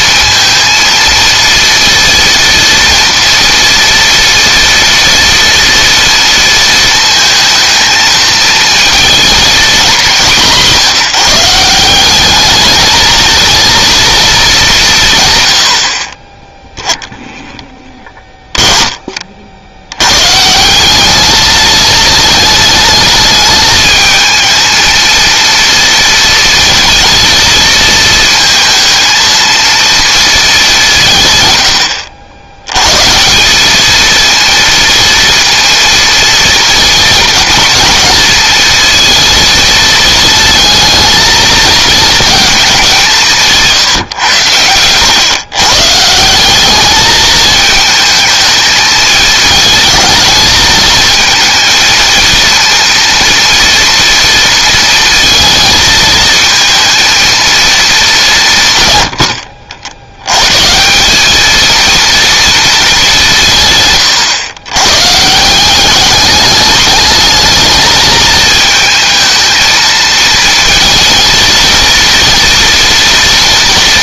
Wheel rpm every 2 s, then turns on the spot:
230, 230, 230, 230, 220, 170, 210, 210, 10, 10, 180, 220, 220, 230, 220, 190, 110, 230, 230, 220, 220, 200, 110, 200, 220, 220, 230, 230, 220, 130, 160, 220, 110, 210, 220, 230, 240.
none